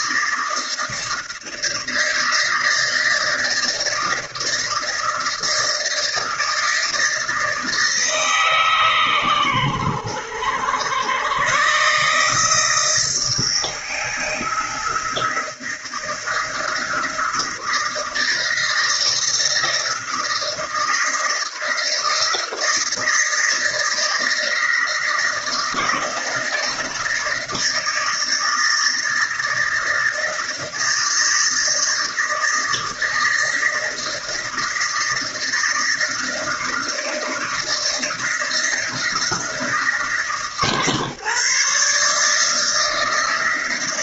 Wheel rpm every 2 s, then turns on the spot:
160, 160, 160, 160, 130, 100, 160, 170, 160, 160, 170, 170, 160, 160, 160, 160, 160, 160, 160, 170, 150, 160.
none